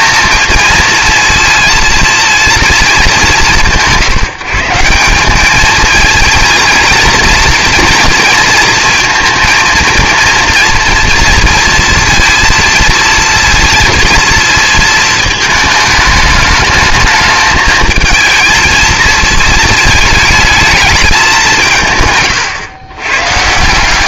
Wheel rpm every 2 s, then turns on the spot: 230, 210, 170, 230, 230, 230, 230, 220, 210, 220, 210, 120.
none